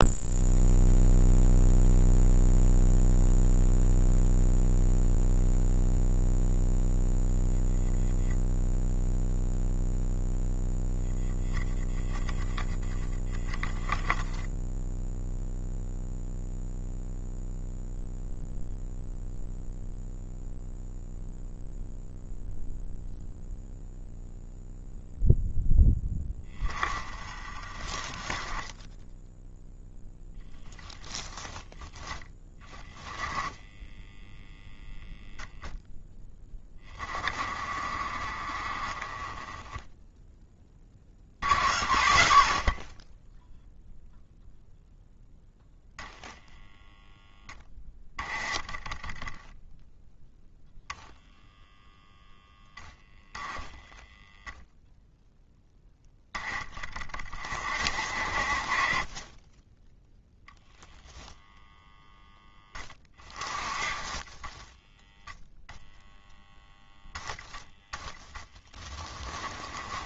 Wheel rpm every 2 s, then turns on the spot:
0, 0, 0, 0, 0, 0, 10, 0, 0, 0, 0, 0, 0, 20, 20, 10, 10, 0, 10, 20, 20, 50, 0, 0, 20, 0, 0, 0, 20, 40, 0, 10, 10, 0, 20.
64-66 68-70